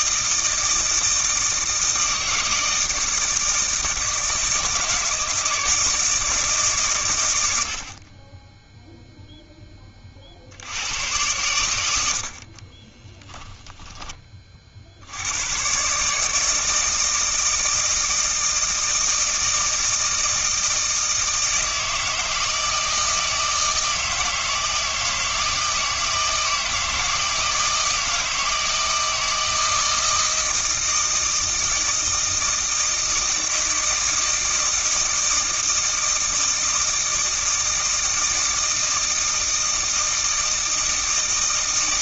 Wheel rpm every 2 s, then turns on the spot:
160, 160, 160, 130, 0, 90, 30, 60, 160, 160, 160, 160, 160, 160, 160, 160, 160, 160, 160, 160, 160.
12-14